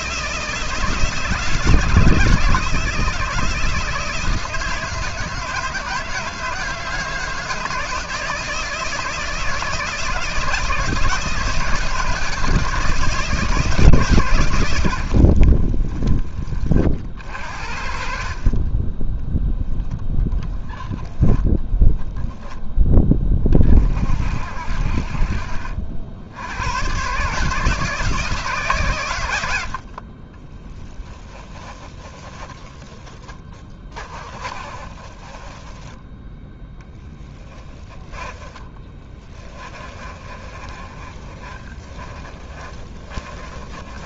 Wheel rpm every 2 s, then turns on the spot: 160, 160, 160, 160, 160, 170, 160, 50, 50, 10, 10, 30, 60, 140, 100, 20, 20, 30, 10, 20, 30, 30.
30-44